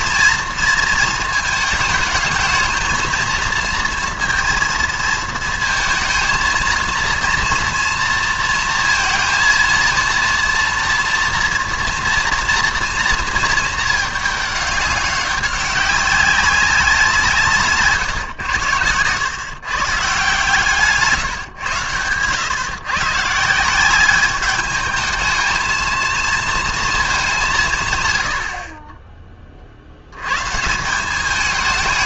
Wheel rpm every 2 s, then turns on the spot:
230, 220, 230, 230, 230, 230, 230, 210, 190, 110, 150, 130, 210, 230, 50, 150.
none